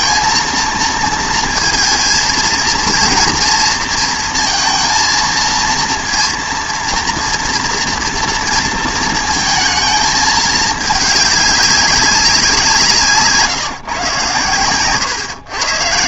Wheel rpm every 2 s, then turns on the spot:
230, 230, 230, 230, 230, 210, 180, 120.
none